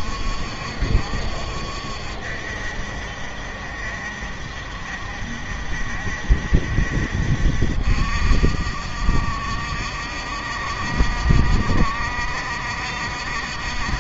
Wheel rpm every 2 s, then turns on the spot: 60, 60, 60, 60, 60, 60, 60.
none